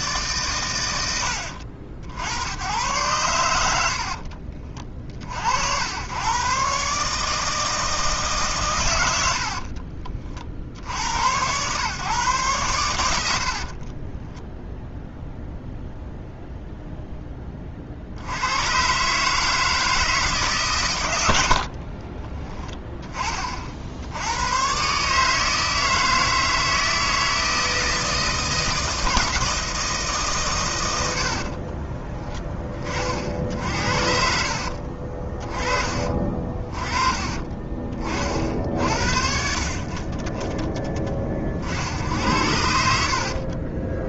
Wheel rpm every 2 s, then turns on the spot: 100, 100, 40, 140, 110, 70, 110, 0, 0, 130, 120, 20, 140, 160, 160, 100, 30, 40, 30, 60, 20, 60.
34-36